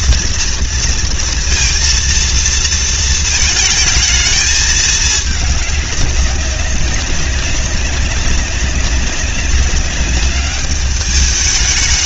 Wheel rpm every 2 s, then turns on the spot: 230, 230, 220, 200, 200, 200.
none